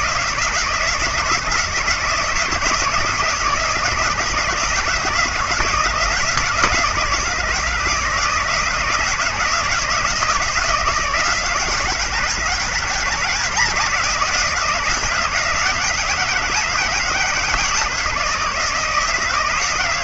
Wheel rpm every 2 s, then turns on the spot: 160, 160, 160, 160, 160, 160, 160, 170, 160, 160.
none